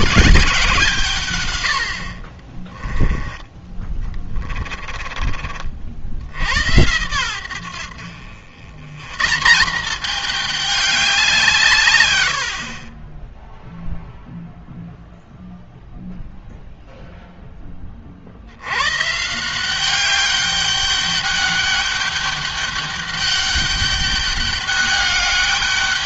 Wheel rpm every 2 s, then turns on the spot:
170, 20, 30, 90, 110, 200, 50, 0, 0, 90, 200, 200, 200.
2-6